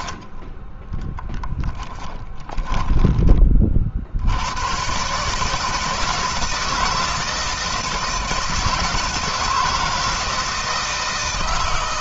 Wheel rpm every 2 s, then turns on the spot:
30, 10, 110, 160, 160, 160.
2-4